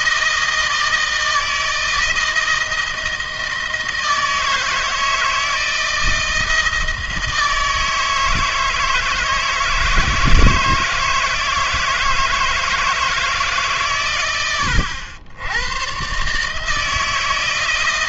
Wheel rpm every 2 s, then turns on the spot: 160, 160, 160, 160, 160, 160, 160, 100, 150.
none